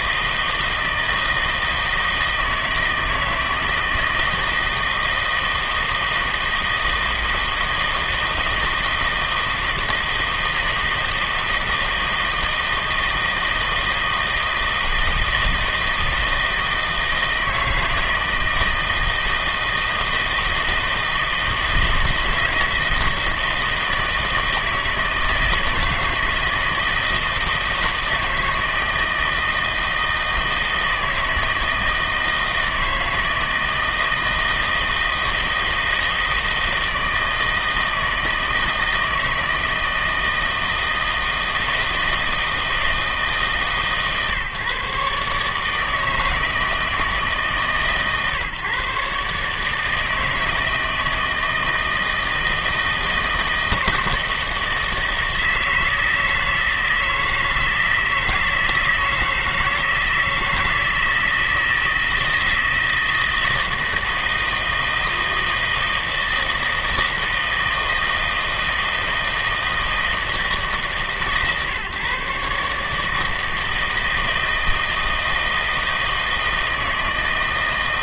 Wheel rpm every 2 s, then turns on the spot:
160, 160, 160, 160, 160, 160, 160, 160, 160, 160, 160, 160, 160, 160, 160, 160, 160, 160, 160, 160, 160, 160, 140, 160, 140, 160, 160, 160, 160, 160, 160, 160, 160, 160, 160, 160, 150, 160, 160.
none